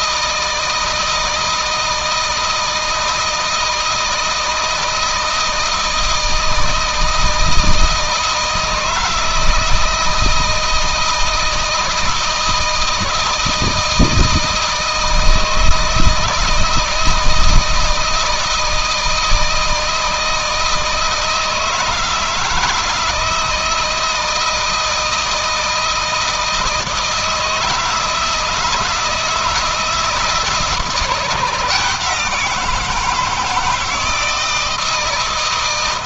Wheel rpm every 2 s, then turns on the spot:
160, 160, 160, 160, 160, 160, 160, 160, 160, 160, 160, 160, 170, 160, 160, 160, 170, 160.
none